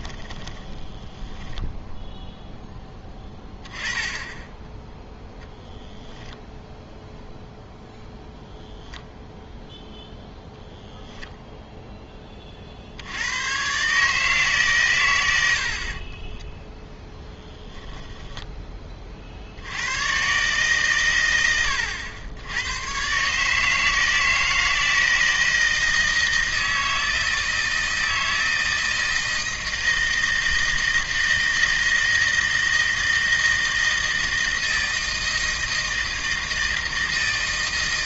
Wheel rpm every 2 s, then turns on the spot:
10, 10, 10, 0, 0, 0, 50, 140, 10, 20, 130, 110, 160, 160, 160, 160, 160, 160, 160.
0-2 16-18